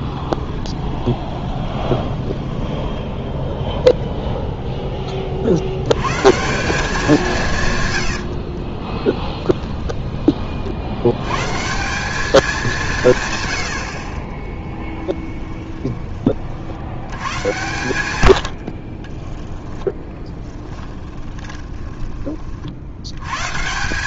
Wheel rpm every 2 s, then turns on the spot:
20, 10, 10, 180, 30, 80, 160, 10, 80, 60, 20, 80.
0-2 8-10 14-16 18-22